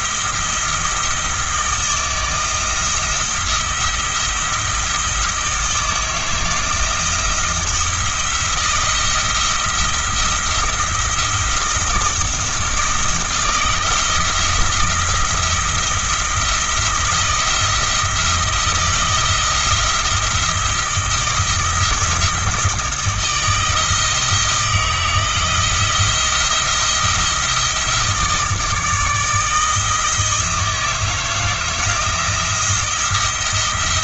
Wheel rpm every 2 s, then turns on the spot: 170, 160, 160, 160, 170, 160, 160, 170, 170, 170, 170, 170, 160, 170, 160, 160, 170.
none